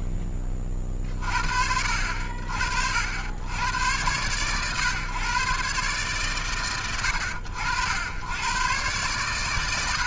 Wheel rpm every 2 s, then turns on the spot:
0, 60, 120, 90, 90.
none